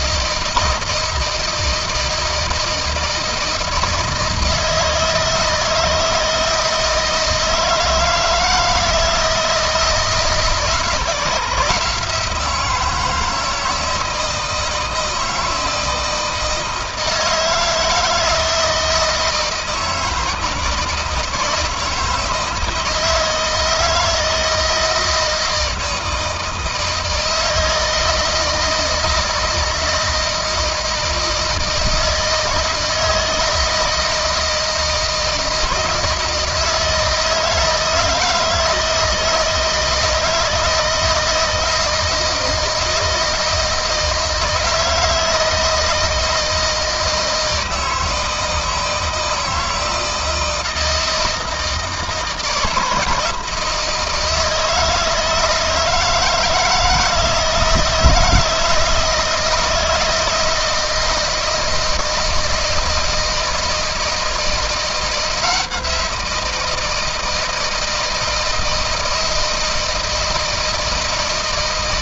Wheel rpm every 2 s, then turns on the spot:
160, 160, 160, 160, 160, 160, 160, 170, 160, 160, 170, 160, 160, 160, 160, 160, 160, 160, 160, 160, 160, 160, 160, 160, 160, 160, 170, 160, 160, 160, 160, 160, 160, 170, 160, 160.
none